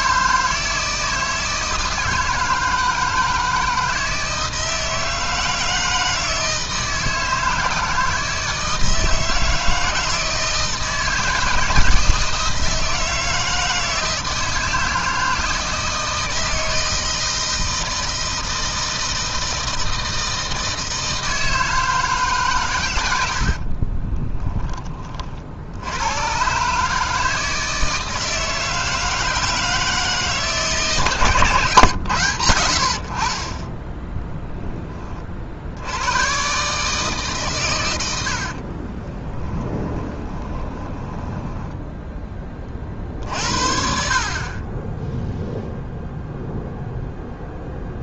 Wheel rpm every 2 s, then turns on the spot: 160, 160, 160, 160, 160, 160, 160, 160, 160, 160, 160, 110, 30, 150, 160, 150, 60, 20, 150, 30, 20, 40, 10, 0.
38-42